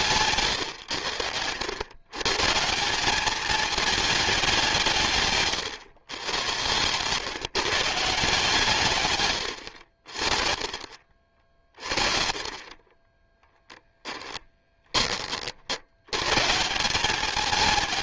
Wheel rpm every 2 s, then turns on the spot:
110, 180, 170, 120, 150, 40, 30, 20, 180.
none